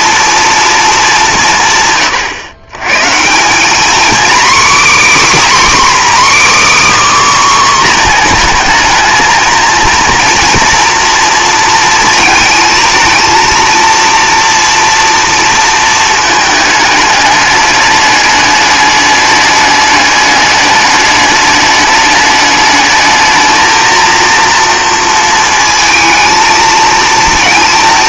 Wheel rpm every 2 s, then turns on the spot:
220, 120, 280, 300, 230, 240, 220, 240, 220, 210, 210, 210, 230, 220.
none